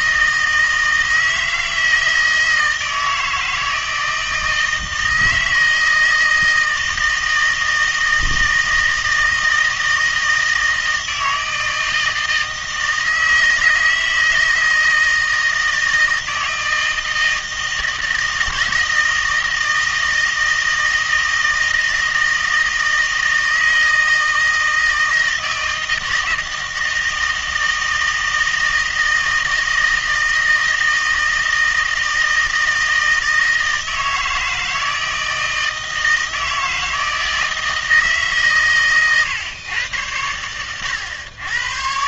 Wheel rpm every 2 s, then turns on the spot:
160, 160, 160, 160, 160, 160, 160, 160, 160, 160, 160, 160, 160, 160, 160, 160, 160, 160, 160, 130, 100.
none